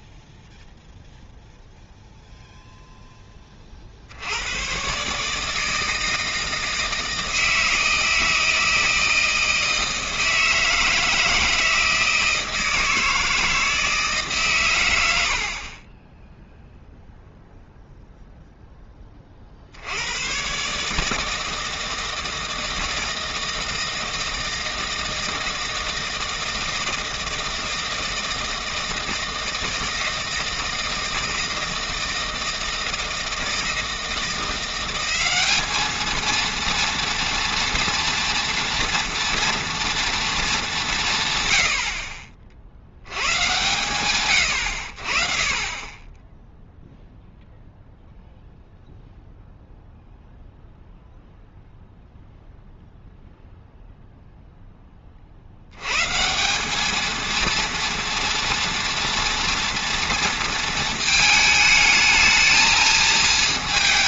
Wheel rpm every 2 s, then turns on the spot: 0, 0, 120, 160, 160, 160, 160, 110, 0, 20, 150, 160, 160, 160, 160, 160, 160, 190, 240, 230, 170, 90, 70, 0, 0, 0, 0, 20, 210, 230, 220, 220.
none